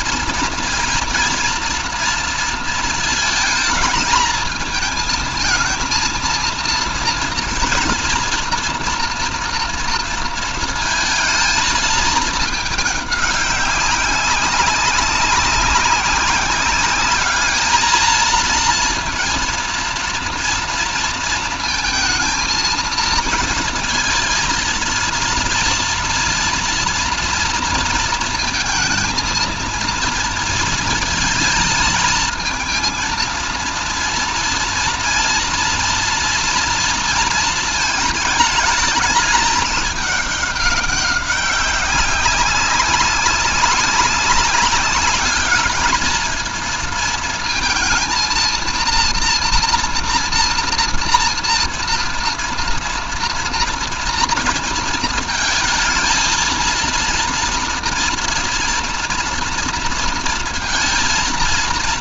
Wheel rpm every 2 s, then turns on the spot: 230, 230, 220, 240, 240, 230, 210, 190, 200, 230, 230, 230, 230, 230, 220, 230, 220, 230, 230, 210, 200, 190, 200, 230, 230, 230, 240, 230, 230, 230, 230.
none